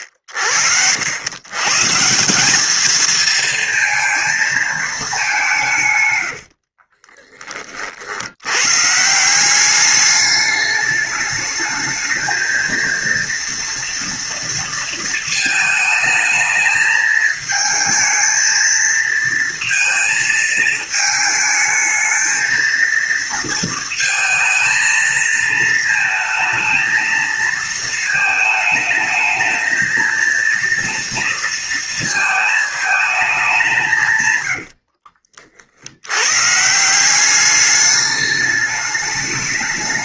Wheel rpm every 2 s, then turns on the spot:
80, 190, 230, 80, 90, 210, 220, 230, 220, 220, 220, 220, 230, 220, 220, 230, 220, 120, 130, 210.
6-8 34-36